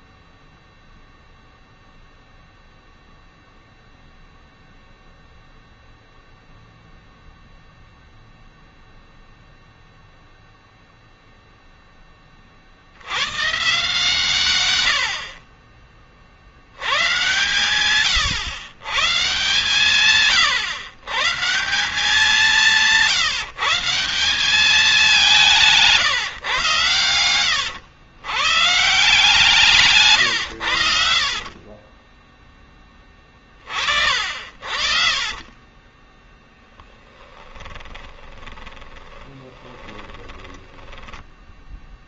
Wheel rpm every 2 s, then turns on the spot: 0, 0, 0, 0, 0, 0, 30, 110, 80, 120, 120, 180, 190, 120, 130, 90, 10, 50, 10, 20, 10.
30-32 34-42